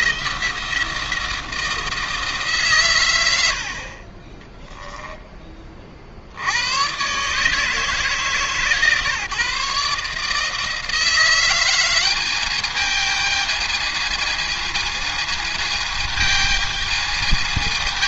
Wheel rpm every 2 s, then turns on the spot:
170, 140, 20, 100, 140, 160, 210, 220, 220.
4-6